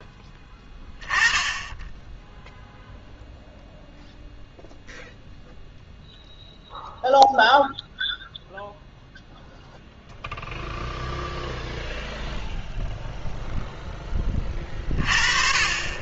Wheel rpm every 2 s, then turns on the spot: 10, 0, 0, 0, 0, 0, 0, 30.
none